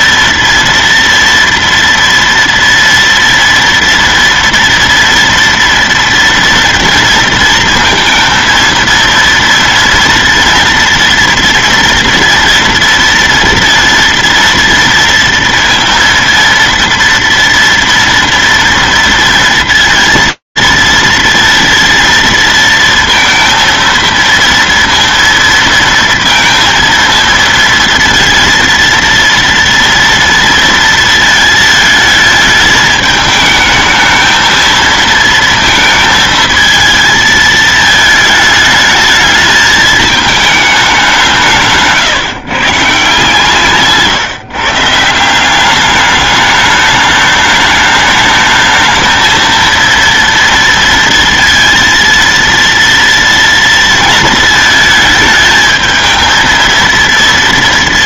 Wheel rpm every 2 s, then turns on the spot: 230, 230, 230, 230, 230, 230, 230, 230, 230, 230, 230, 230, 230, 230, 230, 230, 220, 220, 220, 220, 210, 150, 150, 210, 220, 230, 230, 220, 230.
none